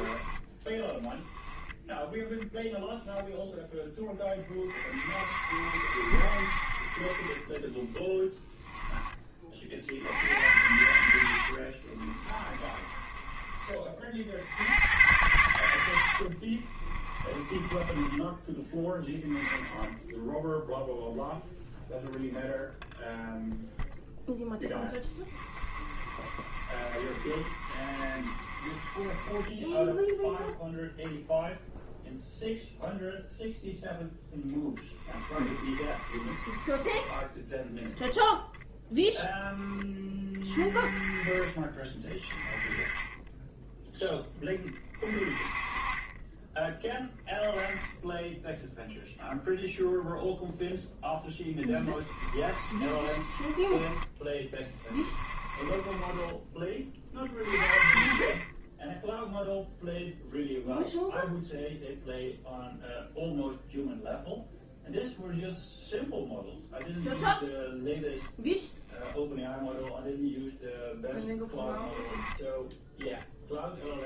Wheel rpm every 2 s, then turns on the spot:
10, 0, 50, 40, 10, 70, 20, 80, 30, 10, 0, 0, 10, 30, 20, 0, 0, 10, 20, 0, 20, 20, 20, 10, 0, 0, 30, 20, 20, 10, 0, 0, 0, 0, 0, 0, 10.
12-14 16-18 24-30 34-38 52-56